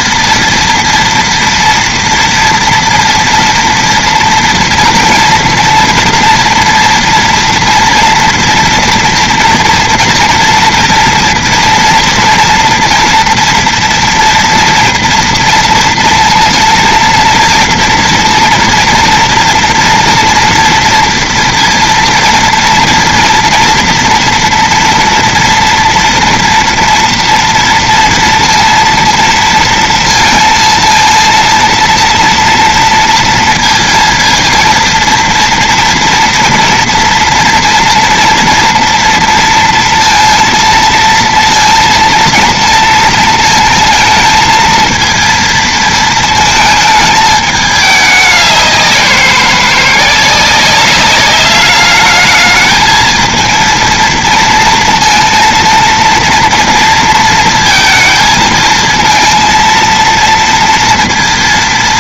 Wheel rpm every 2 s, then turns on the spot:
230, 230, 240, 230, 230, 240, 230, 230, 230, 230, 230, 230, 230, 230, 230, 230, 230, 230, 230, 230, 230, 230, 230, 220, 180, 200, 220, 230, 230, 230, 230.
none